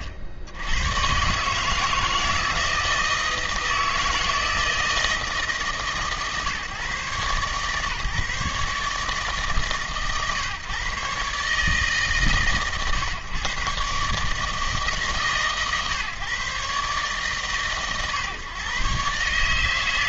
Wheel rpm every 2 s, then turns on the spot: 80, 160, 160, 140, 150, 140, 120, 140, 130, 130.
none